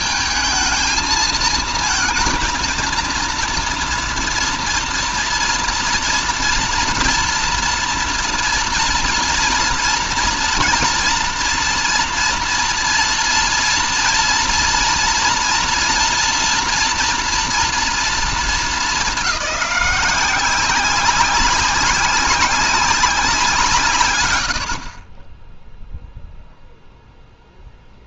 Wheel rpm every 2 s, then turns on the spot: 220, 230, 230, 230, 230, 230, 230, 230, 230, 210, 190, 190, 70, 0.
none